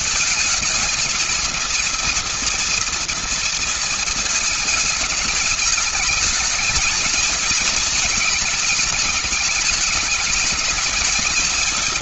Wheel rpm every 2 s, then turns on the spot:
220, 230, 220, 220, 210, 220.
none